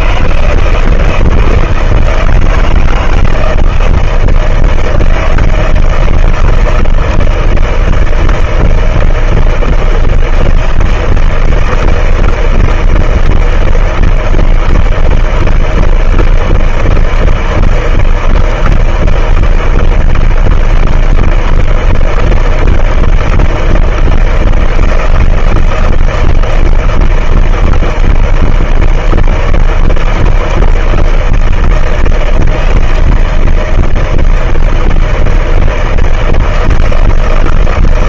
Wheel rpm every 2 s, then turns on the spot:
160, 170, 160, 160, 160, 160, 160, 160, 160, 160, 160, 160, 160, 160, 160, 160, 160, 160, 160.
none